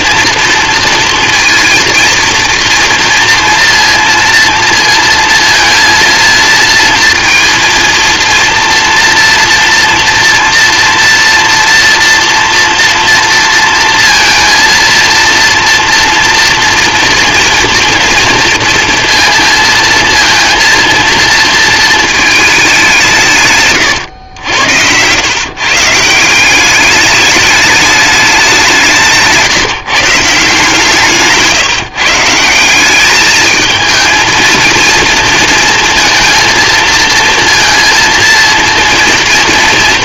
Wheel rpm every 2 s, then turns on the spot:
230, 240, 230, 230, 230, 230, 230, 230, 230, 230, 230, 190, 90, 200, 170, 160, 180, 230, 230, 230.
none